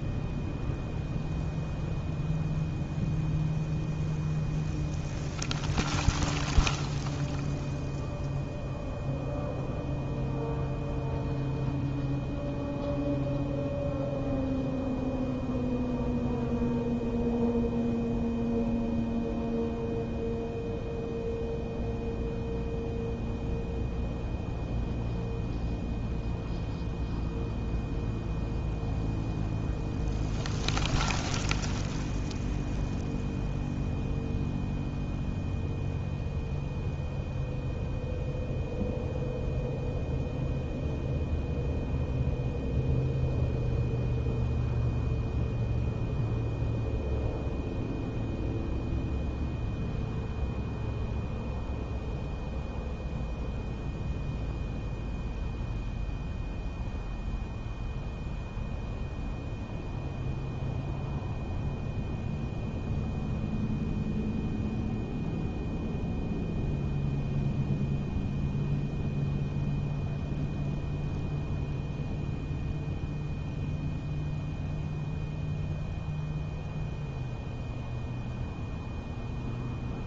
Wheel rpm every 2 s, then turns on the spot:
0, 0, 0, 0, 0, 0, 0, 0, 0, 0, 0, 0, 0, 0, 0, 0, 0, 0, 0, 0, 0, 0, 0, 0, 0, 0, 0, 0, 0, 0, 0, 0, 0, 0, 0, 0, 0, 0, 0, 0.
none